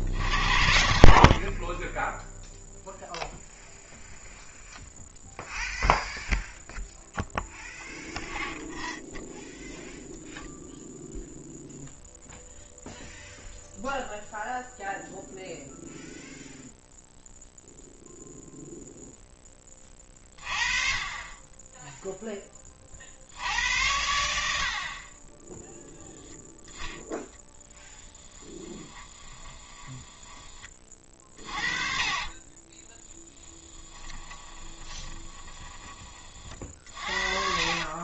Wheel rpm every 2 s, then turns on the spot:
60, 0, 0, 0, 0, 0, 0, 0, 0, 0, 30, 20, 60, 0, 20, 30, 20, 20, 40.
28-30 34-36